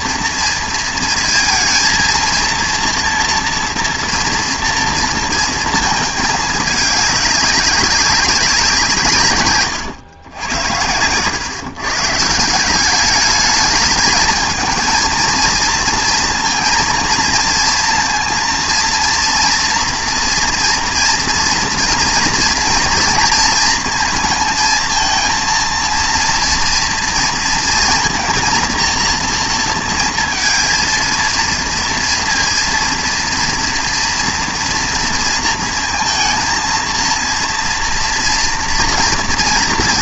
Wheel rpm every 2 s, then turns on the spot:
230, 230, 230, 210, 180, 100, 190, 220, 230, 230, 240, 230, 230, 230, 230, 230, 230, 230, 230, 230.
none